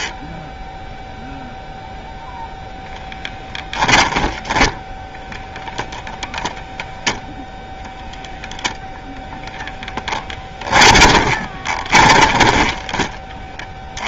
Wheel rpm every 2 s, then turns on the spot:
0, 0, 20, 0, 0, 10, 20.
4-6 10-14